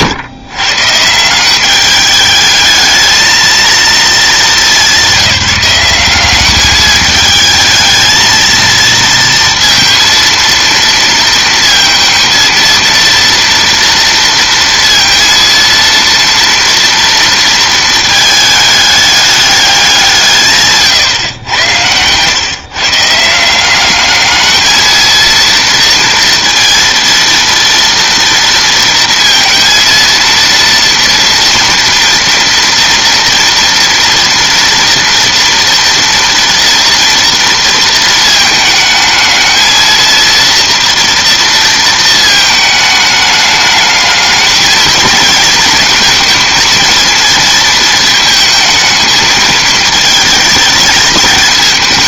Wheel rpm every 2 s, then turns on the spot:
150, 220, 200, 210, 230, 230, 230, 230, 230, 210, 140, 150, 230, 230, 230, 230, 230, 230, 240, 220, 230, 220, 220, 230, 220, 210.
20-22